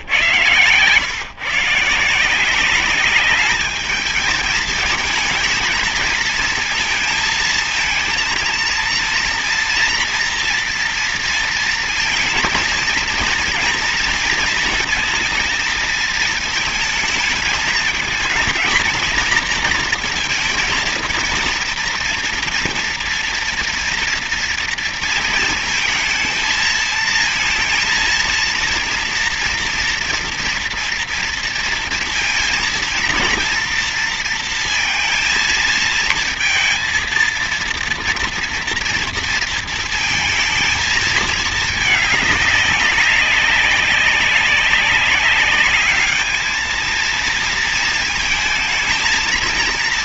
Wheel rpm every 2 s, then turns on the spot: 140, 180, 220, 230, 230, 230, 220, 230, 220, 220, 230, 230, 230, 220, 230, 230, 230, 230, 230, 230, 230, 200, 190, 220, 220.
none